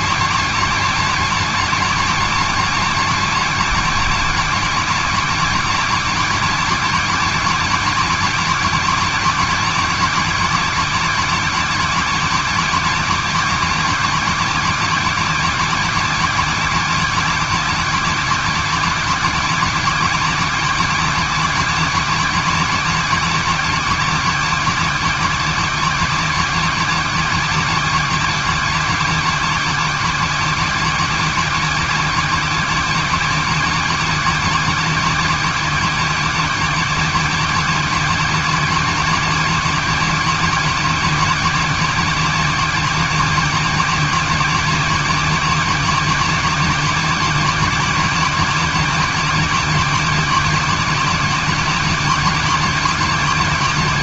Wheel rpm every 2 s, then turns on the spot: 270, 270, 260, 260, 260, 270, 270, 270, 270, 270, 270, 270, 270, 270, 270, 270, 270, 260, 260, 260, 270, 270, 270, 270, 270, 260, 270.
none